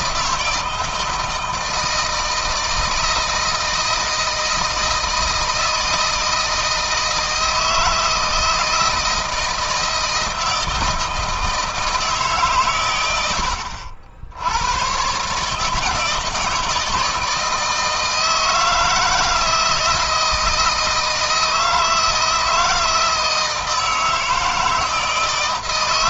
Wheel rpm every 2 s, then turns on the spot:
160, 160, 160, 160, 160, 160, 120, 100, 160, 160, 160, 160, 160.
none